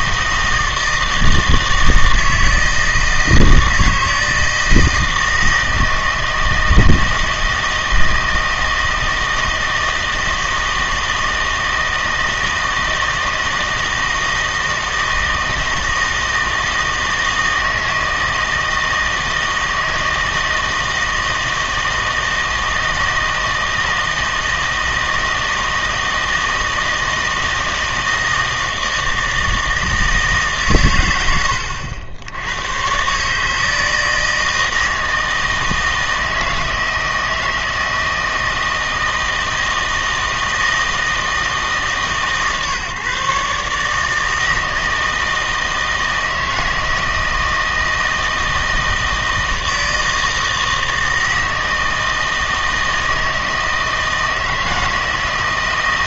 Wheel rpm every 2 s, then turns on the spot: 160, 160, 160, 160, 160, 160, 160, 160, 160, 160, 160, 160, 160, 160, 160, 140, 110, 160, 160, 160, 160, 140, 160, 160, 160, 160, 160, 160.
none